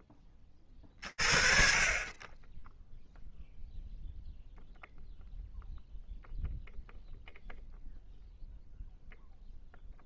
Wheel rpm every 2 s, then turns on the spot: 40, 0, 0, 0, 0.
none